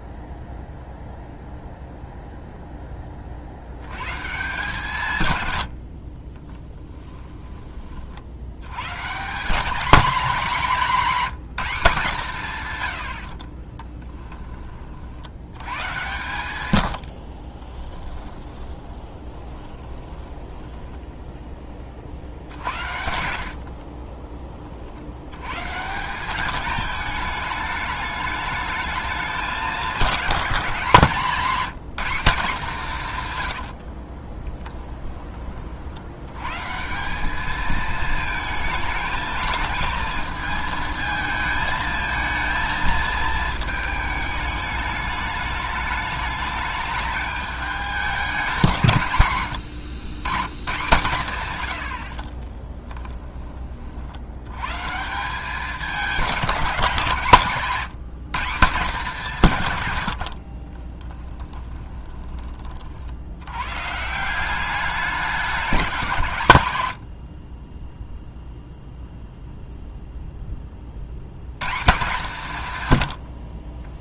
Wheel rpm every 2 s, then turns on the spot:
0, 10, 150, 10, 130, 220, 110, 40, 110, 30, 10, 70, 50, 210, 210, 190, 170, 10, 170, 220, 220, 220, 210, 210, 150, 120, 10, 150, 170, 180, 30, 50, 200, 100, 0, 40, 120.
6-8 16-20 22-24 60-62